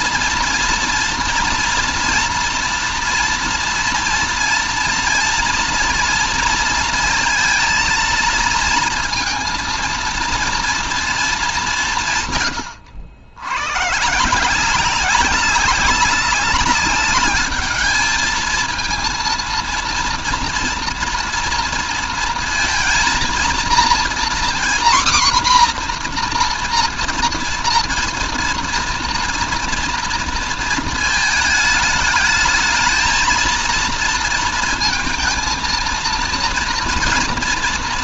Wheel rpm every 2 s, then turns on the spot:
230, 230, 230, 230, 230, 230, 110, 190, 210, 230, 240, 230, 250, 230, 230, 220, 220, 230, 230.
none